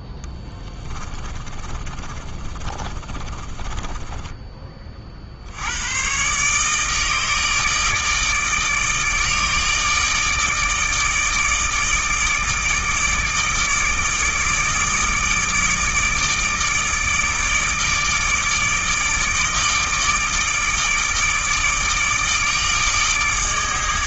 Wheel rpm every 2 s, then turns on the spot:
20, 30, 40, 150, 150, 150, 160, 150, 160, 160, 150, 150.
0-4